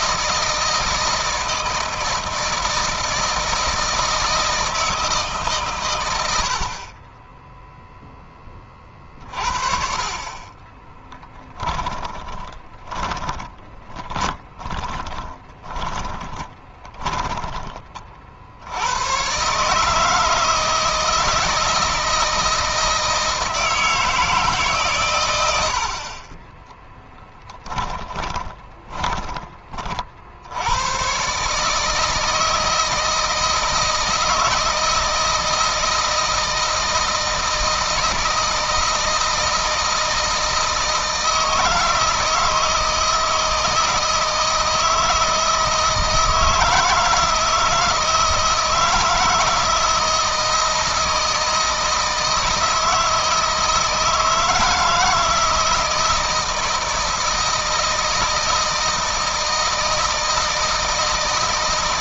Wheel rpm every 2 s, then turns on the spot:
160, 160, 160, 40, 20, 20, 20, 30, 10, 100, 160, 160, 130, 10, 20, 100, 160, 170, 160, 160, 160, 160, 160, 160, 160, 160, 160, 160, 160, 160, 160.
10-18 26-30